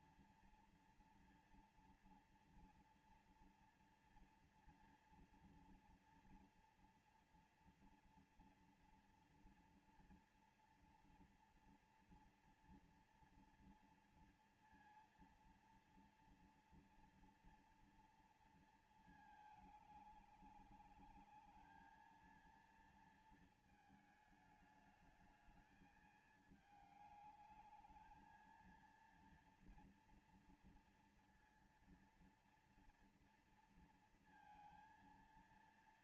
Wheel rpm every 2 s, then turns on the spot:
240, 240, 230, 240, 230, 230, 240, 230, 230, 230, 210, 220, 220, 220, 220, 230, 230, 230.
none